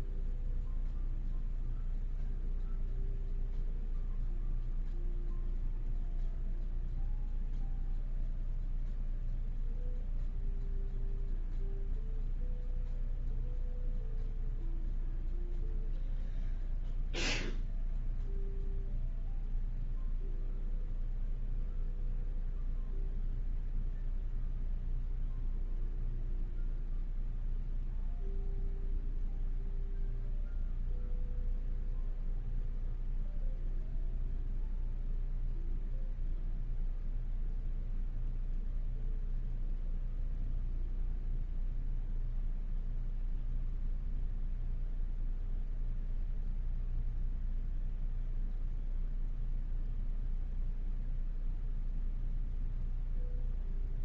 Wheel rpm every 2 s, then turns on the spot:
0, 0, 0, 0, 0, 0, 0, 0, 0, 0, 0, 0, 0, 0, 0, 0, 0, 0, 0, 0, 0, 0, 0, 0, 0, 0, 0.
none